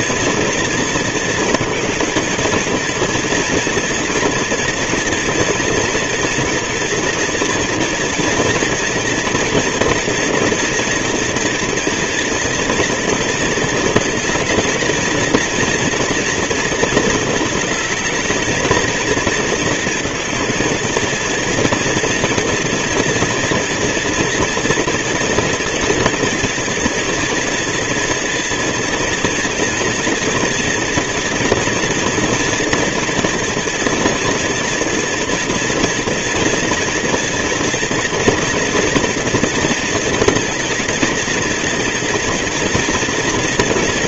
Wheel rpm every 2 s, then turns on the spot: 230, 230, 230, 230, 230, 230, 230, 220, 230, 230, 230, 240, 240, 240, 230, 230, 230, 230, 230, 240, 220, 230.
none